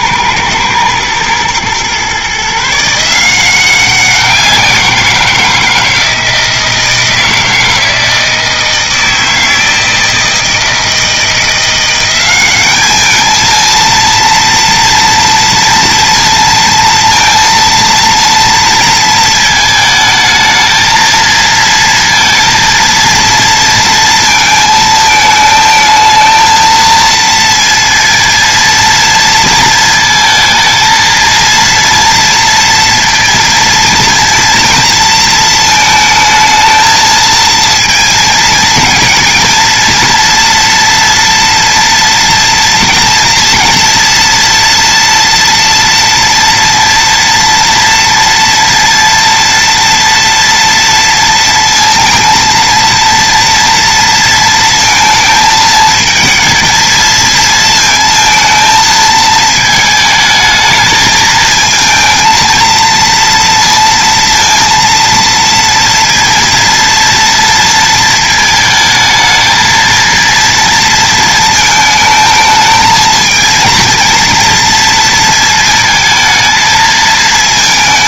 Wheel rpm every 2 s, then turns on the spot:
110, 160, 170, 160, 160, 160, 210, 230, 230, 220, 230, 230, 220, 230, 230, 230, 230, 230, 220, 220, 230, 240, 230, 230, 230, 230, 230, 230, 230, 220, 220, 230, 230, 230, 220, 230, 220, 230, 220.
none